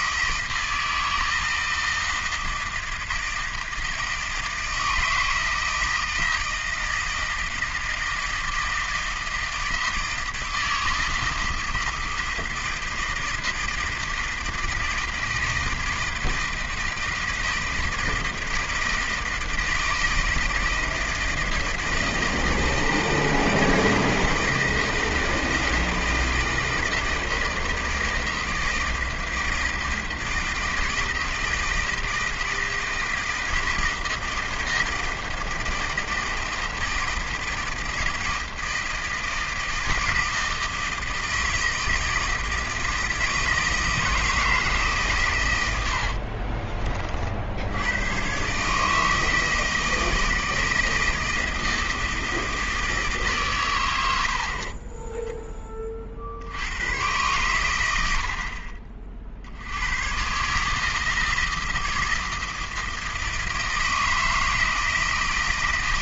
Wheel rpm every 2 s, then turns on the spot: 160, 160, 160, 160, 160, 160, 160, 160, 160, 160, 160, 160, 160, 160, 160, 160, 160, 160, 160, 160, 160, 160, 140, 30, 150, 160, 160, 30, 100, 50, 150, 160, 160.
54-56